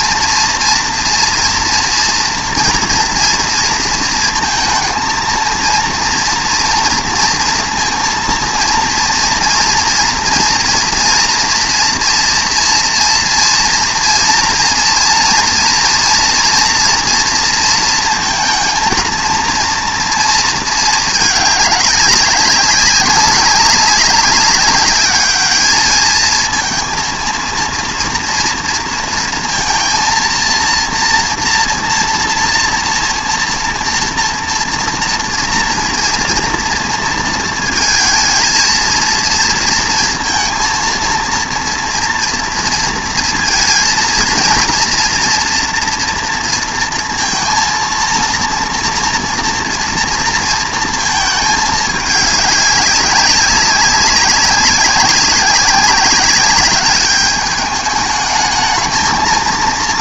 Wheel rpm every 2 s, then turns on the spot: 240, 240, 230, 240, 230, 230, 230, 230, 230, 230, 220, 200, 200, 230, 230, 230, 230, 230, 230, 230, 230, 230, 230, 230, 230, 230, 200, 190, 200, 220.
none